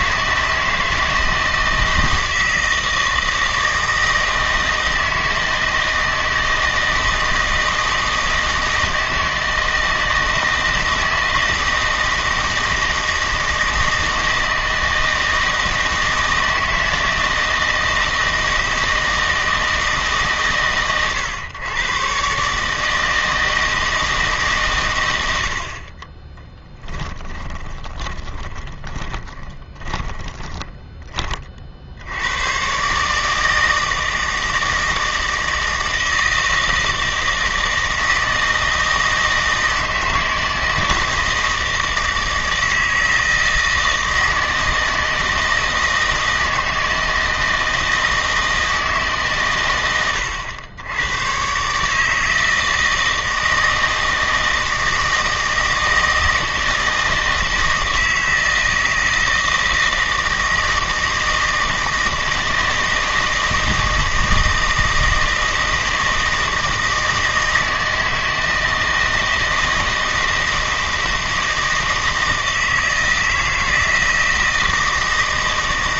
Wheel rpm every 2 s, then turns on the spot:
160, 160, 160, 160, 160, 160, 160, 160, 160, 160, 140, 150, 140, 10, 20, 10, 120, 160, 160, 160, 160, 160, 160, 160, 160, 90, 160, 160, 160, 160, 160, 160, 160, 160, 160, 160, 160, 160.
26-32